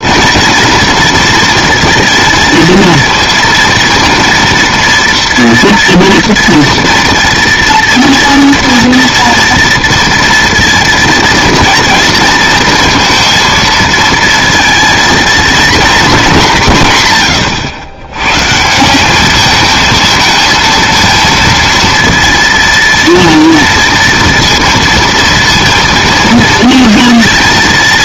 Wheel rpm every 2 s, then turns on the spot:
240, 230, 230, 230, 230, 230, 230, 230, 140, 150, 230, 230, 230, 220.
none